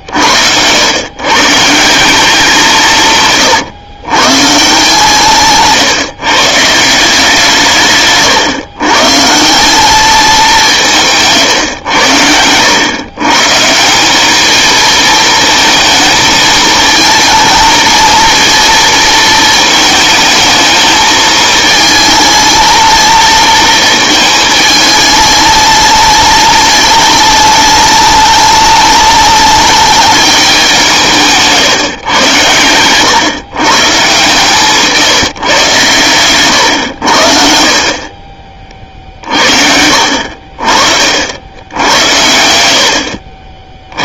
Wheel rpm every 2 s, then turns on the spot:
90, 180, 150, 150, 130, 190, 100, 220, 220, 230, 220, 220, 210, 210, 210, 190, 110, 150, 110, 30, 50, 100.
none